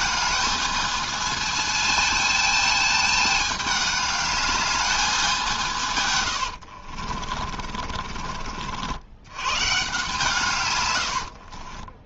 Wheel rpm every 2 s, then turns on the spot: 220, 220, 210, 70, 60, 120.
6-8